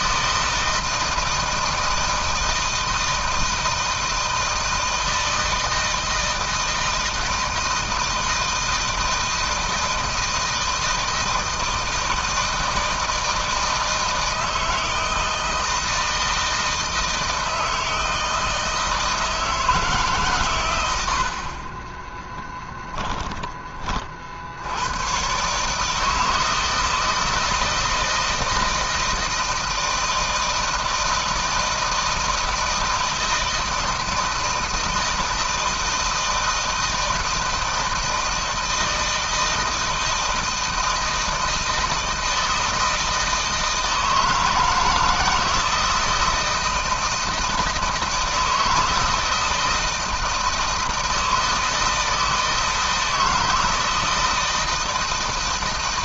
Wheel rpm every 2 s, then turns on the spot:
160, 160, 160, 160, 160, 160, 160, 160, 160, 160, 80, 10, 110, 160, 160, 160, 160, 160, 160, 160, 160, 160, 160, 170, 160, 160, 160, 160.
none